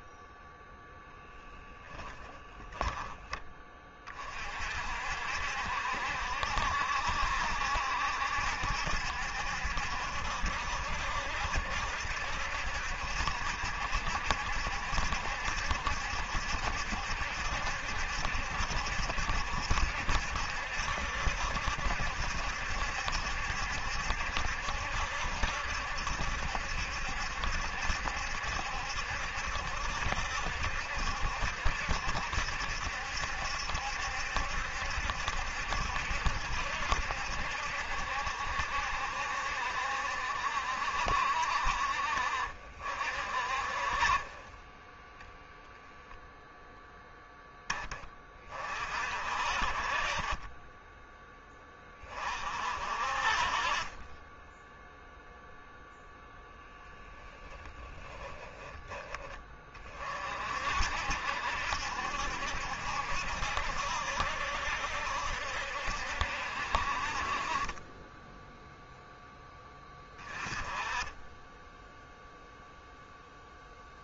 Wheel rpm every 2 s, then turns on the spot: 10, 20, 60, 70, 70, 70, 70, 70, 70, 70, 70, 70, 70, 70, 70, 70, 70, 70, 70, 60, 60, 50, 10, 0, 50, 10, 50, 0, 0, 10, 60, 70, 70, 50, 0, 10, 0.
0-2